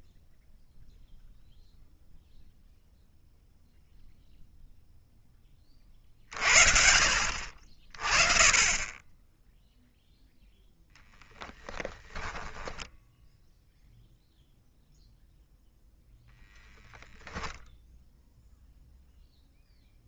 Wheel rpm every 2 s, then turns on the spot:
0, 0, 0, 40, 10, 0, 10, 0, 10, 0.
12-14